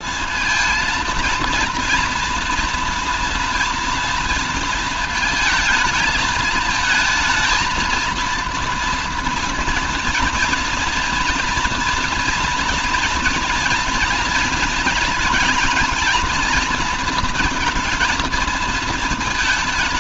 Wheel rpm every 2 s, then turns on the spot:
230, 230, 230, 220, 230, 230, 240, 230, 220, 220.
none